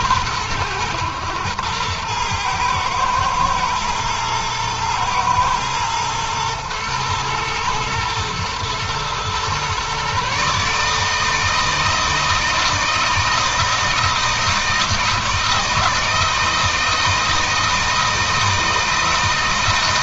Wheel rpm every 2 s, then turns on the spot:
110, 110, 110, 110, 120, 140, 160, 160, 160, 160.
none